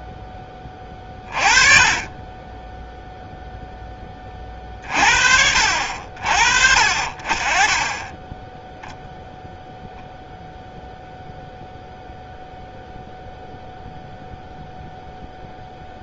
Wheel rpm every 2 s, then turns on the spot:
20, 10, 40, 50, 10, 0, 0, 0.
none